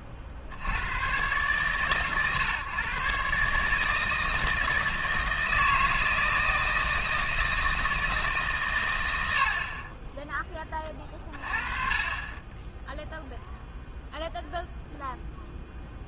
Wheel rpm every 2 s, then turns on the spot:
70, 130, 160, 160, 140, 30, 10, 0.
none